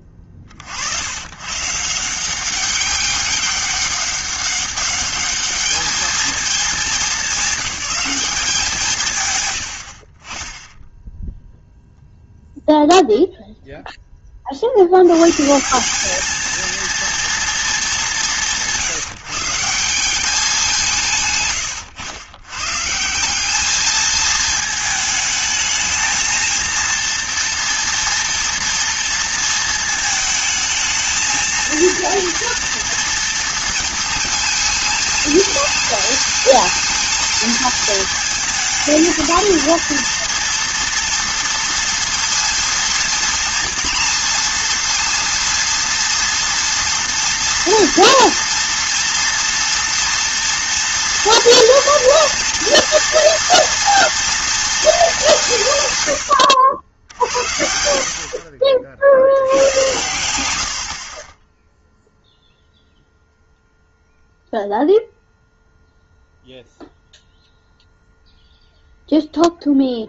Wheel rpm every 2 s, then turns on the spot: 60, 190, 200, 210, 180, 10, 0, 60, 230, 170, 180, 130, 220, 230, 230, 220, 230, 220, 220, 220, 230, 230, 230, 230, 230, 240, 230, 230, 90, 60, 80, 0, 0, 0, 0.
none